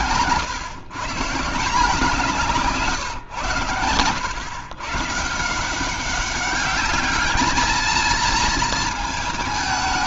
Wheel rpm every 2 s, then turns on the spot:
140, 160, 130, 210, 220.
none